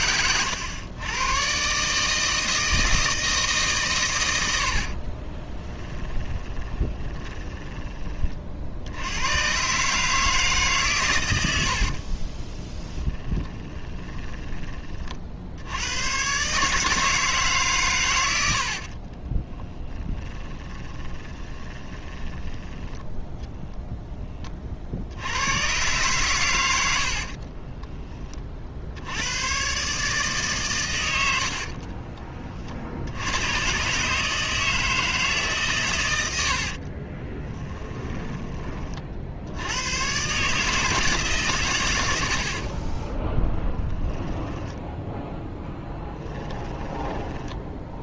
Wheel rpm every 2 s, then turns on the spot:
100, 160, 60, 20, 60, 140, 10, 30, 150, 70, 20, 10, 40, 90, 60, 120, 50, 160, 50, 30, 150, 40, 10, 10.
4-8 12-14 18-24 36-38 42-46